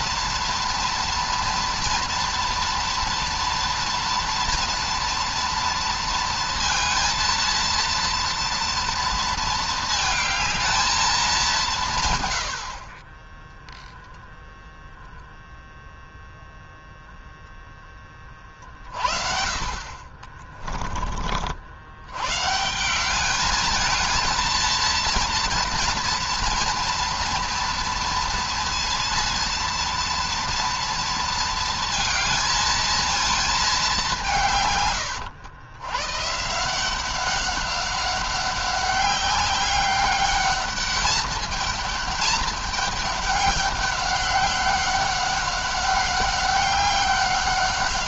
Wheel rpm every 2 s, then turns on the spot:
230, 230, 230, 230, 230, 220, 100, 0, 0, 30, 30, 140, 220, 230, 230, 230, 220, 150, 150, 190, 200, 210, 190, 190.
20-22